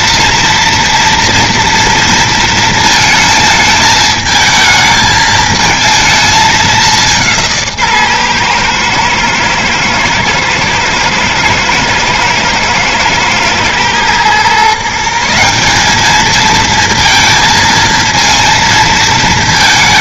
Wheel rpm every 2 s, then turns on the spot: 230, 230, 220, 200, 120, 110, 120, 130, 230, 230.
none